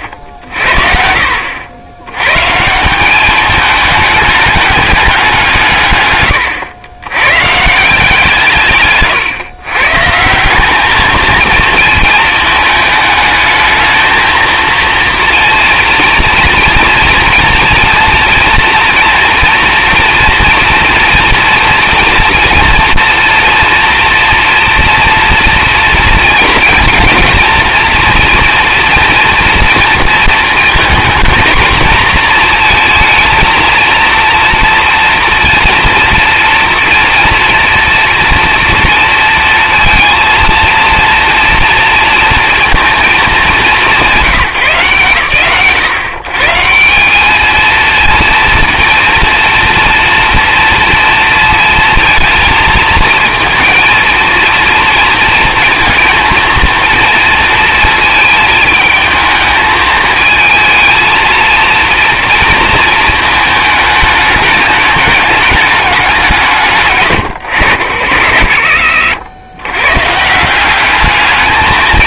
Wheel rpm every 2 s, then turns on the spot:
60, 160, 210, 100, 150, 190, 220, 230, 230, 230, 230, 230, 230, 230, 240, 230, 230, 230, 240, 230, 230, 230, 140, 140, 230, 230, 230, 230, 230, 220, 220, 230, 210, 160, 80, 180.
none